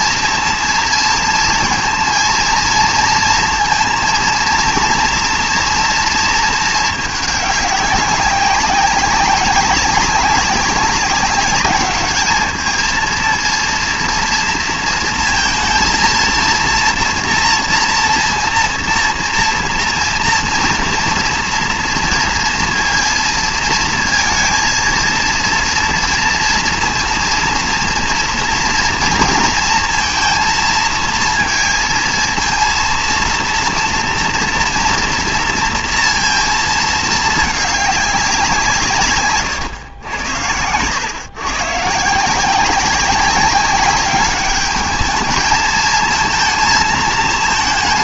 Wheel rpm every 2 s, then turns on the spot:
230, 230, 230, 210, 200, 200, 220, 230, 230, 230, 230, 230, 230, 230, 230, 230, 230, 230, 220, 150, 110, 190, 210, 220.
none